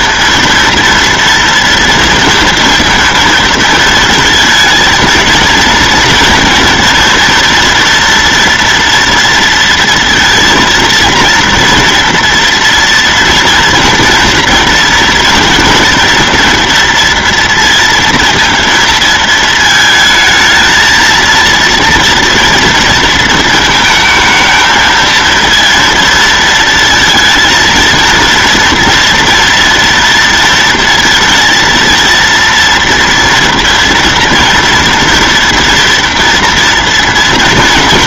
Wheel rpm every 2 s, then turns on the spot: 230, 230, 230, 230, 230, 230, 230, 230, 230, 230, 220, 230, 220, 230, 230, 230, 230, 230, 230.
none